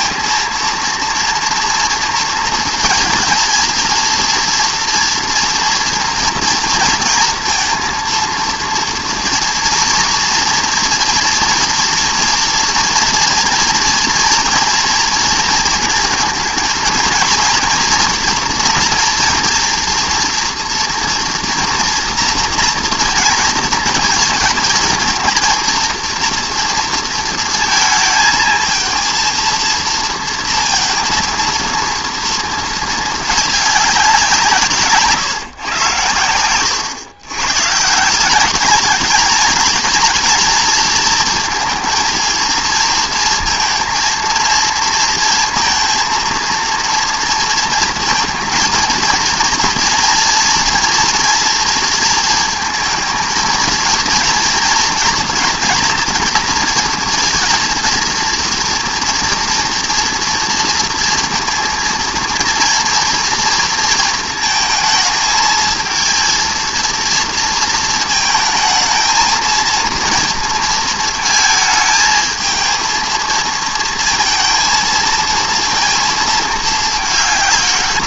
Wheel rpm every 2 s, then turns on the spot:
230, 230, 230, 230, 230, 230, 230, 230, 230, 240, 240, 230, 220, 230, 220, 230, 220, 150, 110, 200, 220, 230, 230, 230, 230, 240, 220, 230, 230, 230, 230, 230, 220, 230, 220, 230, 230, 230, 210.
none